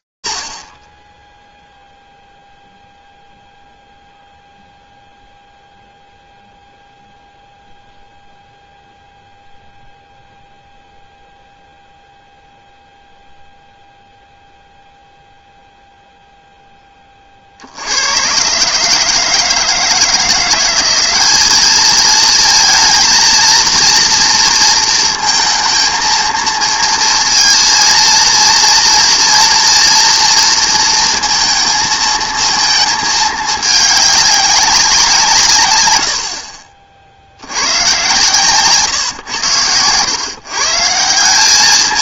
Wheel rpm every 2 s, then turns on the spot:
0, 0, 0, 0, 0, 0, 0, 0, 0, 130, 180, 230, 230, 230, 230, 230, 220, 200, 50, 130, 150.
none